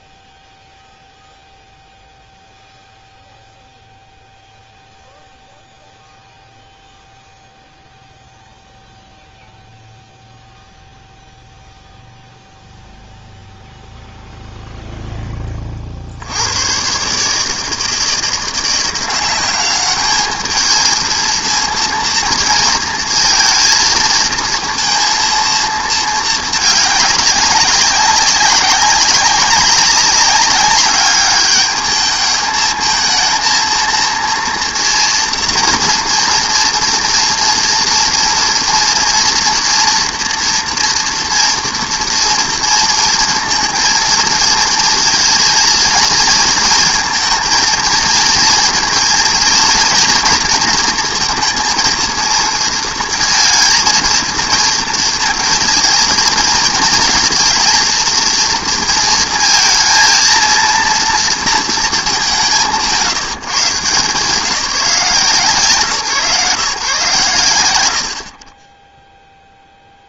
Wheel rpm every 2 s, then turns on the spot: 0, 0, 0, 0, 0, 0, 0, 0, 120, 180, 220, 220, 230, 210, 190, 200, 220, 230, 230, 240, 230, 230, 230, 220, 230, 230, 230, 230, 220, 230, 230, 110, 180, 150, 20.
none